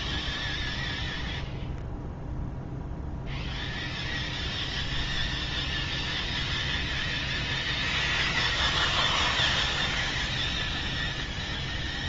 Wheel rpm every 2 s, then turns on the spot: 0, 0, 0, 0, 0, 0.
none